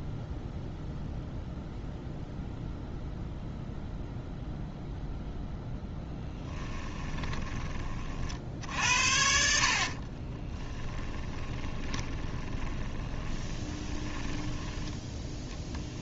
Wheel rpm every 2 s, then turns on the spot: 0, 0, 0, 10, 60, 20, 20, 10.
6-8 10-16